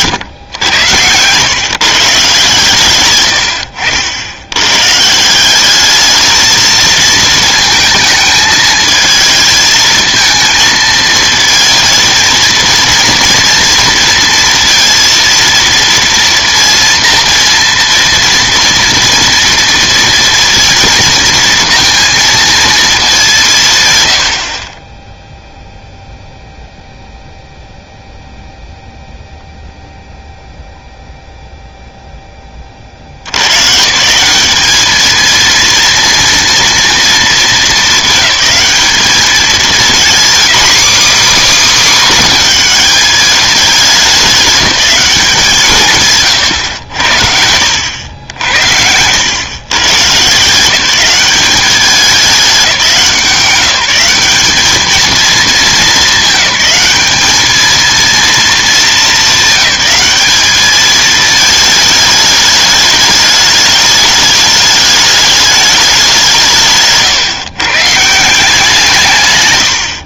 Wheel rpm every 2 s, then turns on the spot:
110, 140, 100, 220, 220, 220, 230, 230, 230, 240, 230, 230, 40, 0, 0, 0, 30, 200, 230, 210, 270, 240, 200, 110, 80, 160, 200, 200, 200, 230, 210, 210, 210, 160, 170.
none